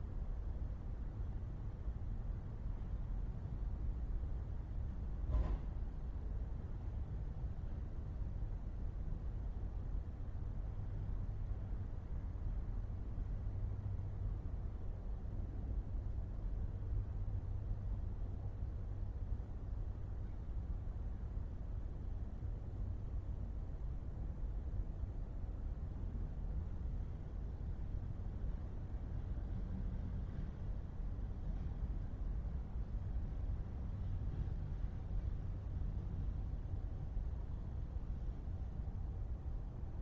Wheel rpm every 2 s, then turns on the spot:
0, 0, 0, 0, 0, 0, 0, 0, 0, 0, 0, 0, 0, 0, 0, 0, 0, 0, 0, 0.
none